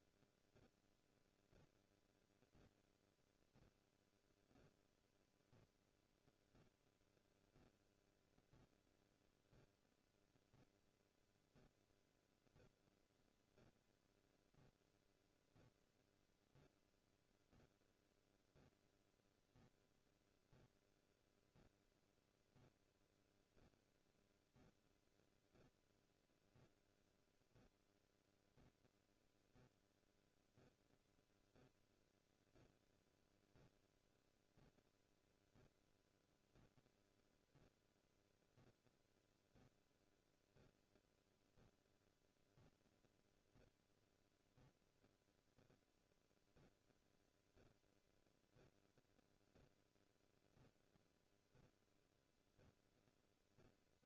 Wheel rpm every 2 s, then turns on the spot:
0, 0, 0, 0, 0, 0, 0, 0, 0, 0, 0, 0, 0, 0, 0, 0, 0, 0, 0, 0, 0, 0, 0, 0, 0, 0, 0.
none